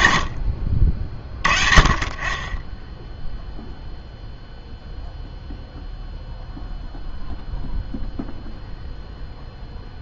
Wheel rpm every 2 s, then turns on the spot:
50, 10, 0, 0, 0.
none